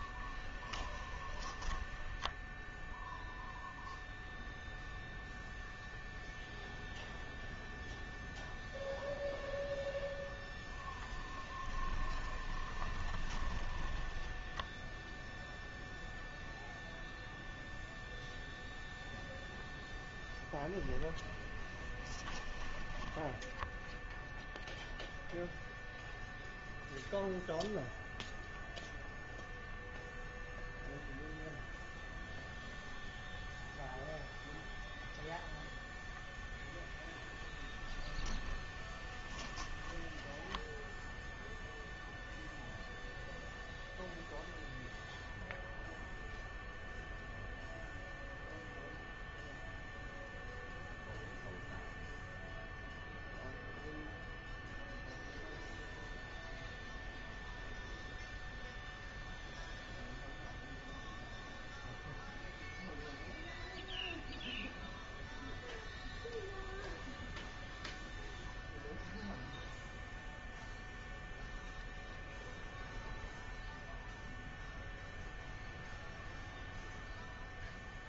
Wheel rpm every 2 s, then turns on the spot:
20, 0, 0, 0, 0, 0, 10, 0, 0, 0, 10, 10, 0, 0, 0, 0, 0, 0, 0, 10, 0, 0, 0, 0, 0, 0, 0, 0, 0, 0, 0, 0, 0, 0, 0, 0, 0, 0, 0.
0-2 20-22 38-40